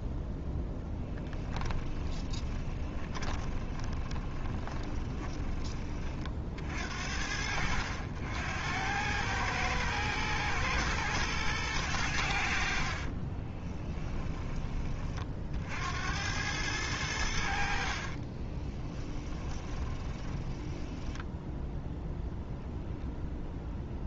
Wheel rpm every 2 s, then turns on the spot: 10, 30, 20, 60, 100, 120, 50, 30, 90, 10, 10, 10.
2-6 12-14 18-22